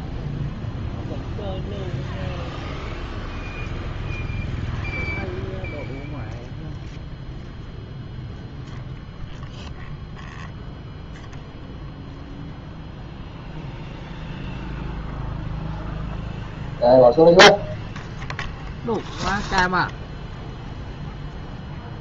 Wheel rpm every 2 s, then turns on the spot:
0, 0, 0, 0, 0, 0, 0, 0, 0, 0, 0.
none